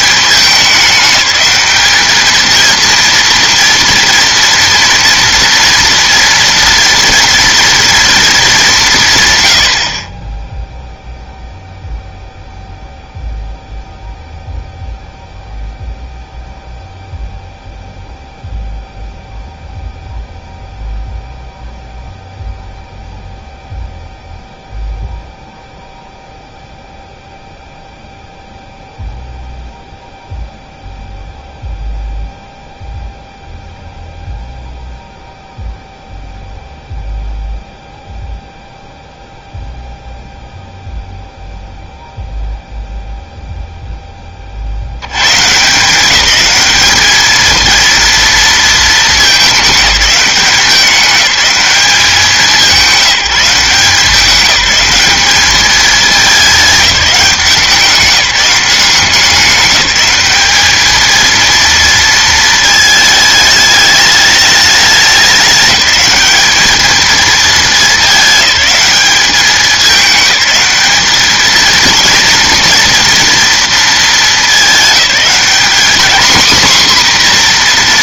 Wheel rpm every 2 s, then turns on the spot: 200, 230, 230, 230, 200, 0, 0, 0, 0, 0, 0, 0, 0, 0, 0, 0, 0, 0, 0, 0, 0, 0, 60, 210, 230, 200, 190, 200, 200, 180, 210, 220, 210, 210, 210, 210, 240, 200, 240.
none